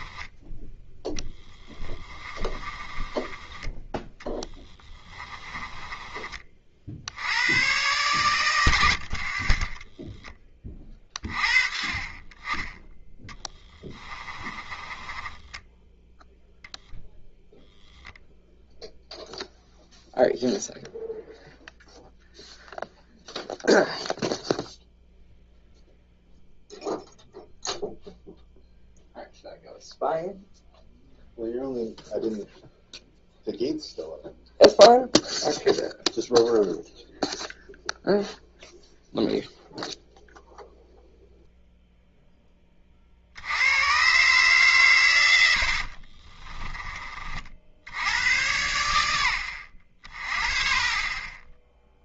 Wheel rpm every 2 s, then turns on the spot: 10, 20, 20, 60, 80, 30, 10, 20, 0, 0, 0, 0, 0, 0, 0, 0, 0, 0, 0, 0, 0, 30, 130, 20, 100, 40.
2-6 8-10 14-16